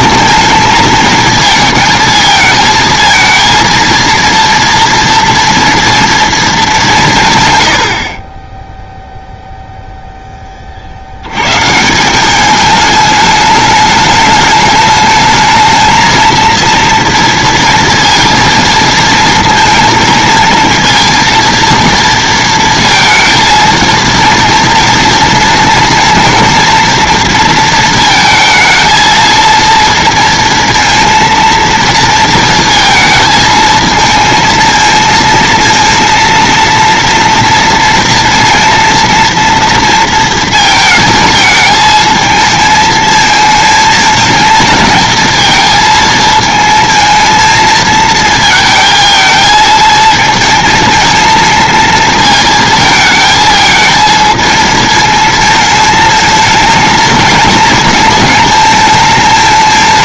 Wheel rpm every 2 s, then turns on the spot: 220, 220, 230, 210, 10, 20, 210, 210, 230, 230, 220, 230, 230, 240, 220, 230, 230, 230, 230, 230, 230, 220, 220, 220, 220, 220, 230, 220, 220, 220.
none